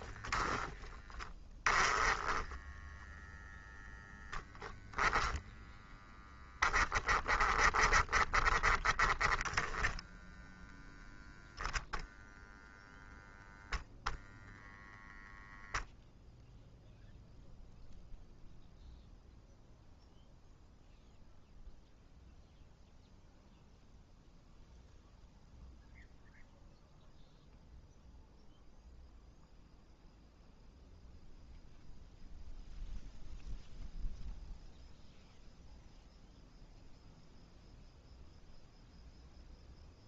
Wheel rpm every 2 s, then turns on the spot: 10, 10, 0, 10, 10, 0, 0, 0, 0, 0, 0, 0, 0, 0, 0, 0, 0, 0, 0, 0.
none